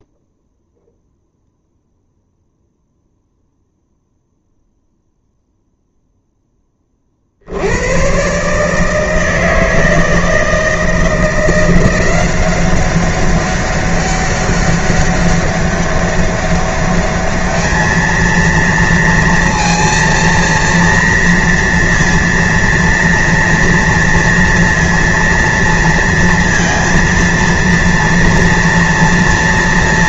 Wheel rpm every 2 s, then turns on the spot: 0, 0, 0, 20, 150, 160, 190, 200, 200, 230, 230, 230, 230, 230, 230.
none